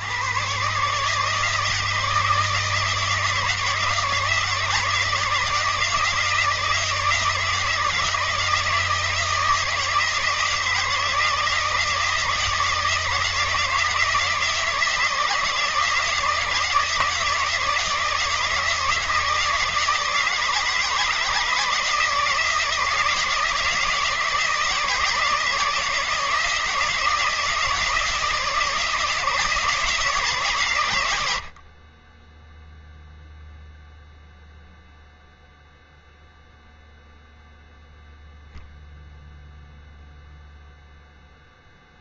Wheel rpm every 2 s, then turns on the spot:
130, 160, 160, 160, 160, 160, 160, 160, 160, 160, 160, 160, 160, 160, 160, 120, 0, 0, 0, 0, 0.
none